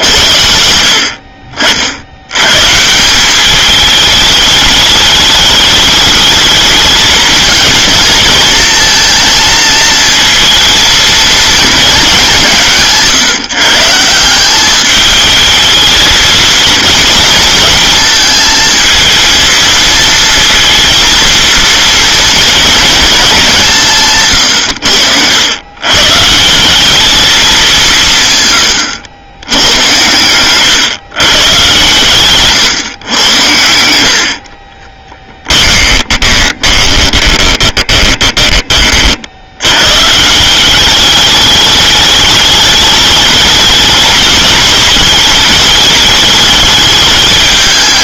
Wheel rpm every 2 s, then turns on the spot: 70, 150, 210, 220, 230, 230, 160, 210, 220, 220, 230, 230, 100, 210, 100, 130, 120, 30, 20, 30, 190, 210, 210, 210.
34-38